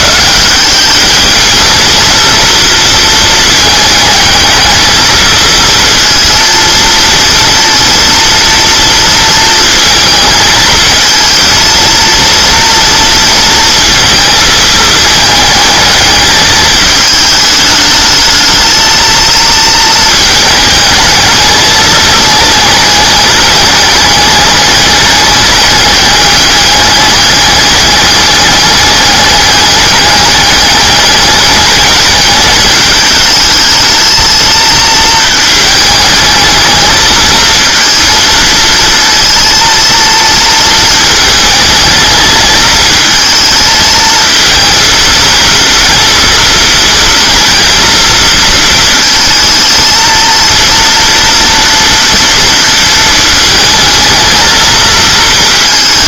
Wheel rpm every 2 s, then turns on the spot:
210, 230, 220, 230, 230, 220, 230, 220, 220, 220, 210, 210, 200, 200, 210, 210, 210, 220, 220, 230, 220, 220, 230, 230, 220, 230, 230, 230.
none